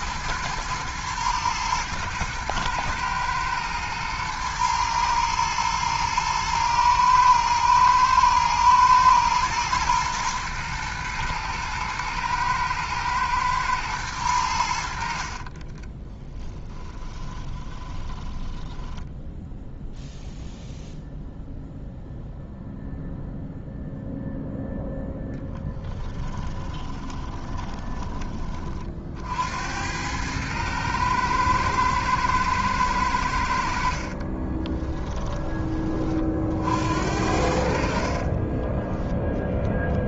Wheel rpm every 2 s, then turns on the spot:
110, 110, 110, 110, 110, 110, 110, 70, 20, 10, 0, 0, 0, 20, 50, 110, 100, 20, 70, 10.
16-20 26-28 34-36 38-40